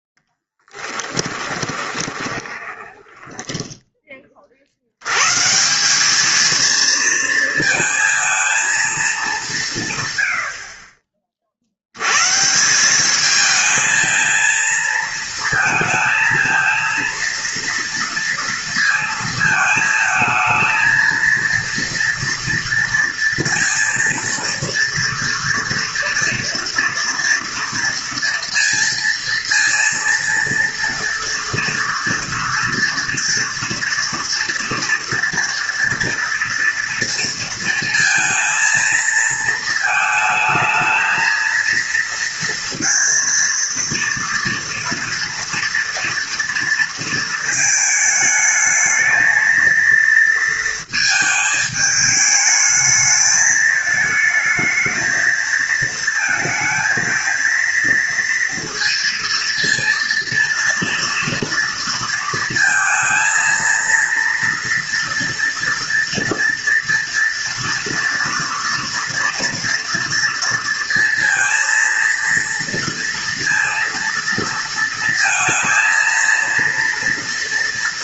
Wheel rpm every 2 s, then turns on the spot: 10, 20, 50, 220, 230, 70, 160, 230, 230, 230, 220, 230, 230, 230, 230, 230, 230, 240, 230, 230, 220, 230, 230, 230, 220, 230, 220, 220, 220, 230, 230, 230, 230, 230, 230, 230, 230, 230, 230.
0-4